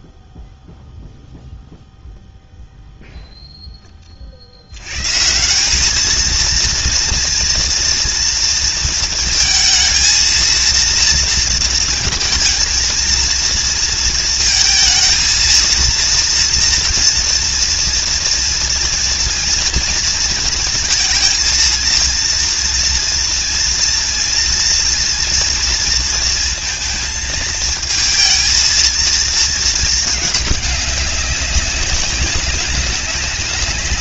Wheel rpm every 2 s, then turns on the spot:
0, 30, 220, 230, 230, 230, 230, 230, 230, 230, 230, 230, 230, 230, 220, 190, 200.
none